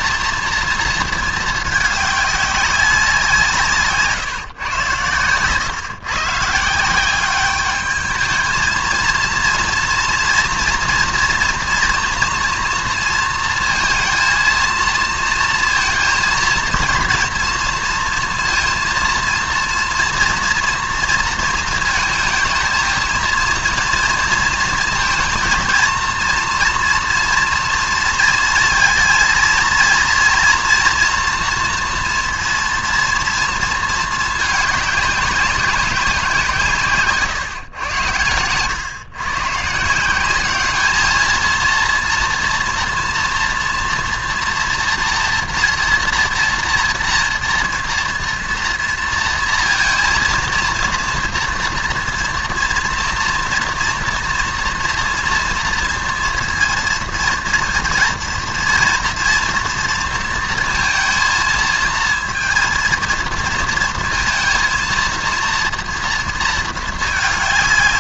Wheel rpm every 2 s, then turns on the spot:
230, 200, 120, 180, 220, 230, 230, 230, 230, 230, 230, 220, 230, 230, 230, 230, 230, 200, 150, 120, 210, 230, 240, 230, 230, 230, 230, 230, 230, 230, 230, 230, 230, 220.
none